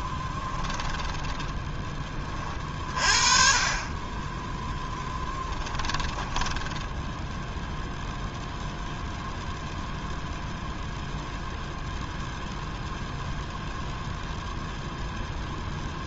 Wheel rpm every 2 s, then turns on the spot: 10, 40, 20, 10, 0, 0, 0, 0.
0-2 4-8